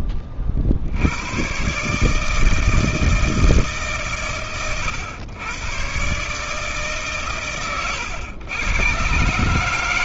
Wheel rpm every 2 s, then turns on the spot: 60, 160, 130, 140, 100.
none